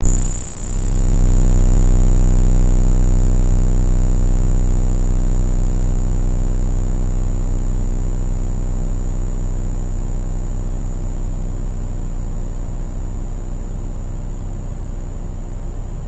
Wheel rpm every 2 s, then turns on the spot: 0, 0, 0, 0, 0, 0, 0, 0.
none